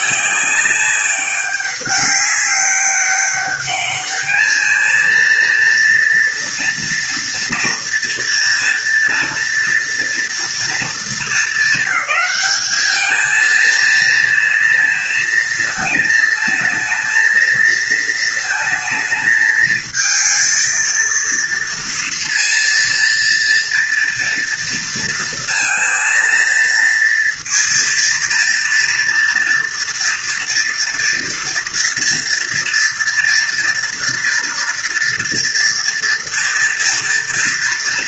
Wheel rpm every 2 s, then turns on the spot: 200, 200, 230, 230, 230, 230, 220, 230, 220, 220, 230, 230, 230, 230, 230, 230, 230, 230, 230.
none